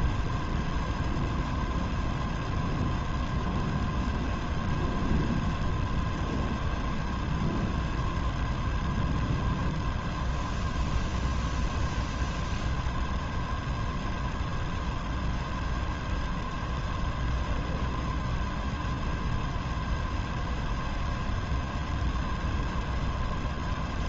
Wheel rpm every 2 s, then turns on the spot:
0, 0, 0, 0, 0, 0, 0, 0, 0, 0, 0, 0.
none